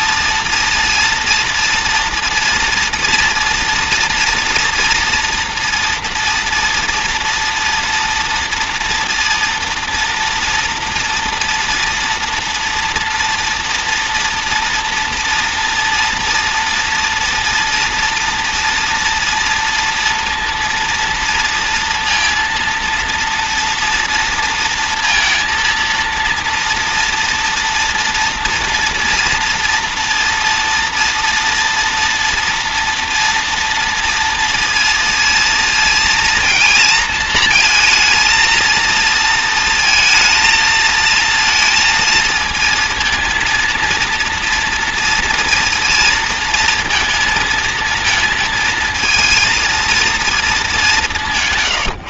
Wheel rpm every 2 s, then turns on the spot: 230, 230, 230, 230, 230, 230, 230, 240, 230, 240, 230, 230, 230, 230, 230, 230, 240, 230, 230, 220, 220, 230, 230, 220, 220, 210.
none